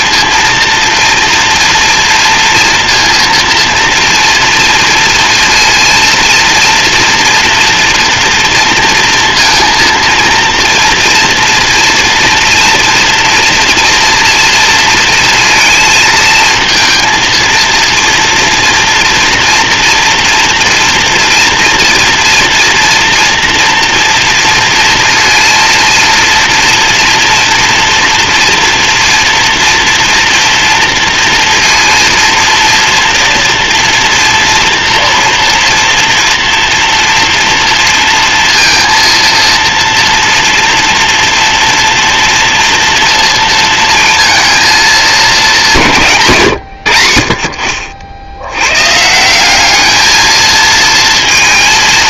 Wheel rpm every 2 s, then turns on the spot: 230, 230, 230, 230, 230, 240, 230, 230, 230, 230, 230, 230, 230, 230, 240, 230, 230, 230, 240, 230, 230, 230, 210, 80, 140, 230.
none